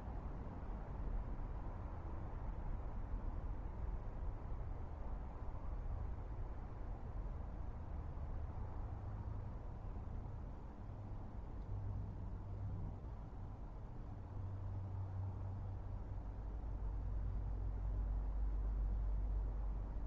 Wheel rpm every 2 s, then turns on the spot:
0, 0, 0, 0, 0, 0, 0, 0, 0, 0.
none